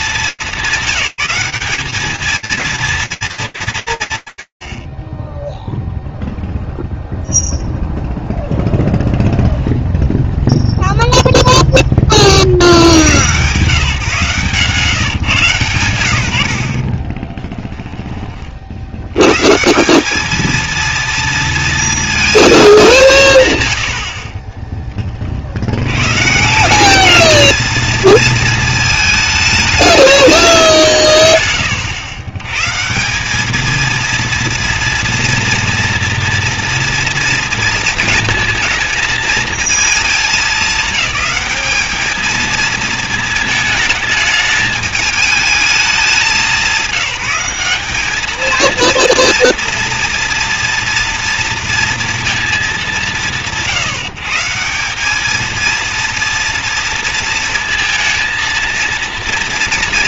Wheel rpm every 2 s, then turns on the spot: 190, 220, 90, 0, 0, 0, 60, 140, 80, 50, 230, 190, 10, 190, 220, 180, 140, 230, 230, 220, 210, 230, 210, 200, 230, 230, 200, 190, 230, 230.
none